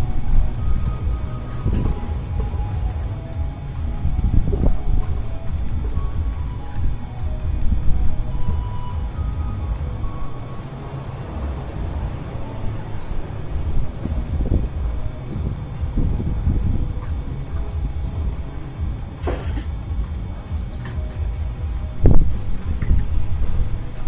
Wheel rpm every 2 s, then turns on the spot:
0, 0, 0, 0, 0, 0, 0, 0, 0, 0, 0, 0.
none